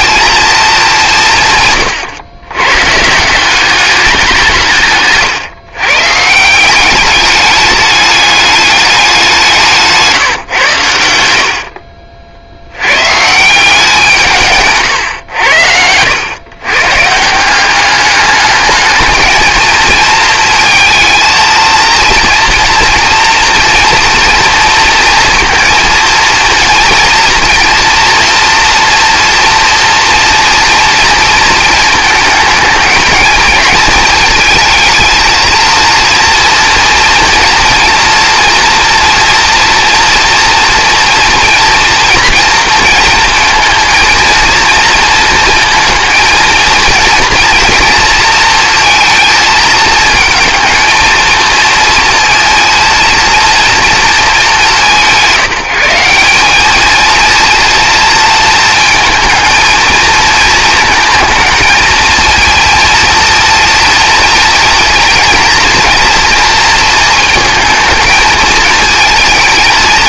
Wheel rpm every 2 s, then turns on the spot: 200, 130, 150, 190, 200, 110, 110, 130, 140, 220, 220, 230, 230, 240, 230, 230, 220, 220, 230, 230, 230, 230, 230, 230, 230, 220, 230, 180, 220, 220, 220, 230, 230, 230, 220.
none